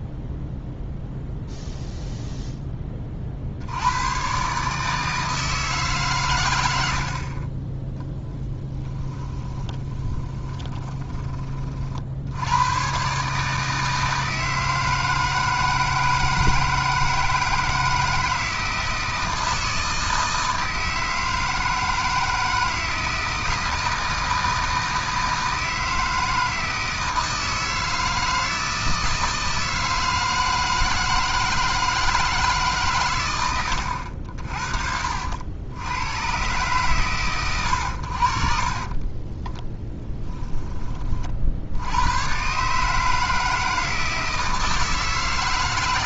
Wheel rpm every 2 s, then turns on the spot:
0, 20, 150, 70, 20, 20, 120, 160, 160, 160, 160, 160, 160, 160, 160, 160, 130, 50, 120, 40, 20, 150, 160.
8-12 38-40